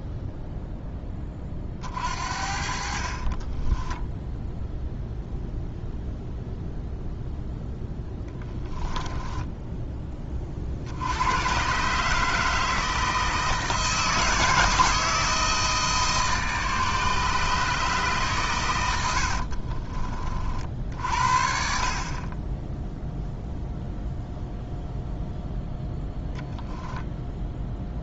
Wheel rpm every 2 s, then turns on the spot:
10, 50, 0, 0, 10, 60, 160, 160, 150, 110, 50, 0, 0, 0.
2-4 8-10